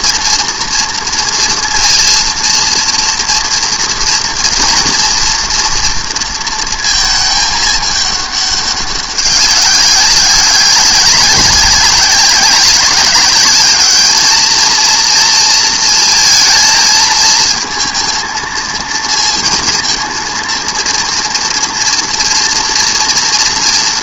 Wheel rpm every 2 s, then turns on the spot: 230, 230, 230, 230, 200, 200, 190, 220, 220, 230, 230, 230.
none